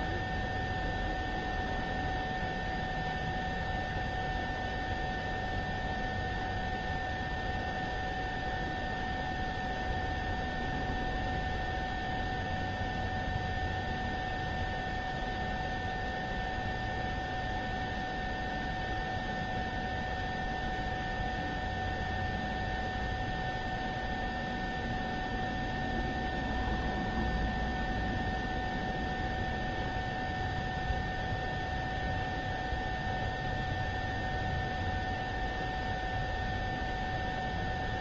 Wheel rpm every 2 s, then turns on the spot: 0, 0, 0, 0, 0, 0, 0, 0, 0, 0, 0, 0, 0, 0, 0, 0, 0, 0, 0.
none